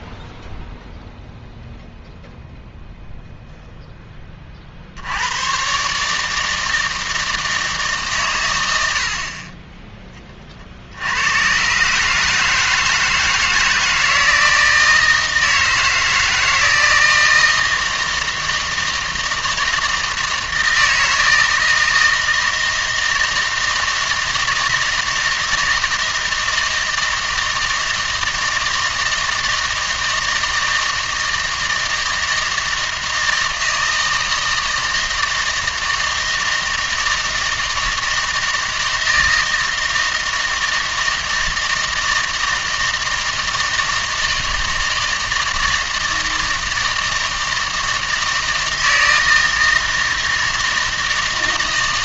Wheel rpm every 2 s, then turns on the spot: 0, 0, 50, 160, 100, 50, 160, 160, 160, 160, 160, 160, 160, 160, 160, 160, 160, 160, 160, 160, 160, 160, 160, 160, 160, 160.
none